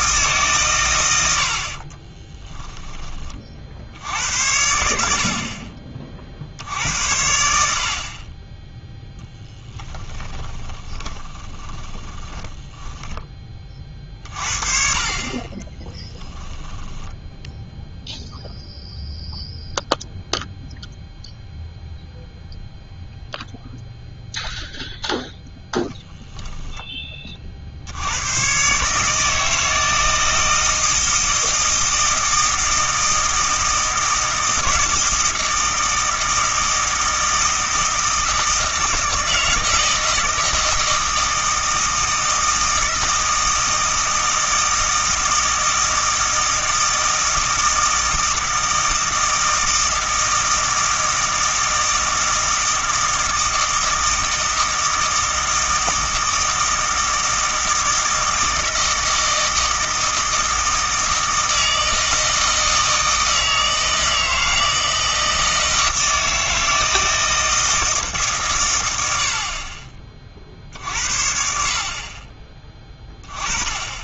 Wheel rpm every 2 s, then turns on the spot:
130, 10, 80, 60, 20, 20, 20, 40, 10, 0, 0, 0, 0, 0, 120, 160, 160, 160, 160, 160, 160, 160, 160, 160, 160, 160, 160, 160, 160, 160, 160, 160, 160, 160, 120, 50, 20.
2-4 10-14 16-18